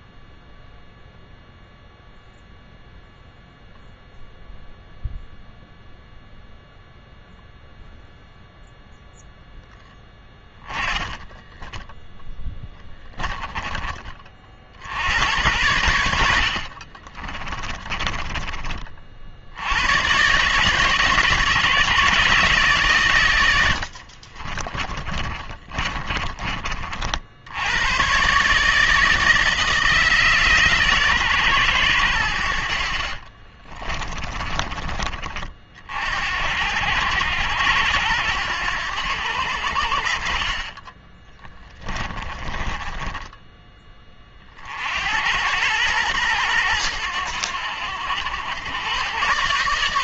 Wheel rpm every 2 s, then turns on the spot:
0, 0, 0, 0, 0, 10, 10, 70, 40, 40, 140, 130, 30, 50, 150, 140, 60, 30, 80, 90, 20, 20, 60, 100, 100.
10-14 16-18 24-26 32-34 40-44